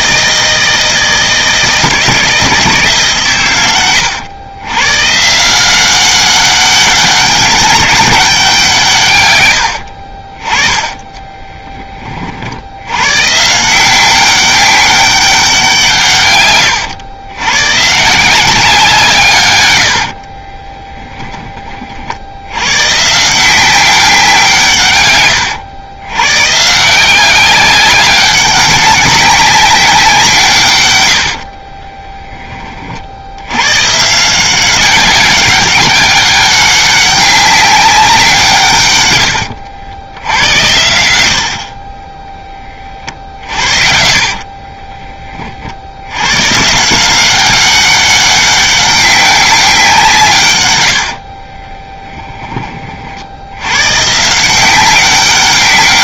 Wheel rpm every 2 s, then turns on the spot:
160, 150, 120, 200, 160, 20, 90, 200, 100, 170, 20, 120, 150, 160, 200, 130, 50, 190, 200, 130, 100, 20, 30, 150, 200, 100, 40, 190.
10-12 20-22 40-42 44-46